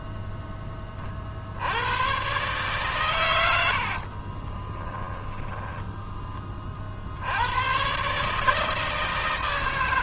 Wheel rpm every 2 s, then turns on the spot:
10, 130, 10, 30, 160.
4-6